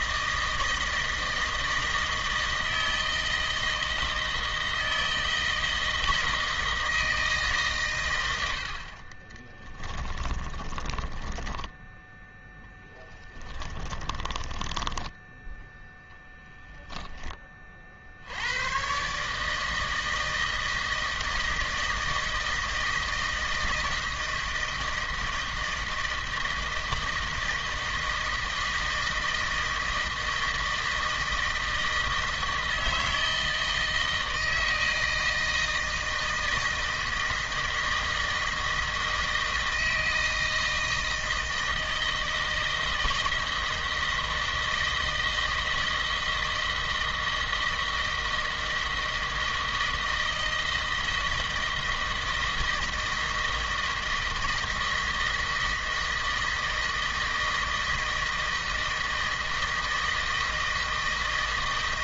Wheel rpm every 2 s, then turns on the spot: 160, 160, 160, 160, 50, 20, 0, 10, 10, 120, 160, 160, 160, 160, 160, 160, 160, 160, 160, 160, 160, 160, 160, 160, 160, 160, 160, 160, 160, 160, 160.
10-12 14-16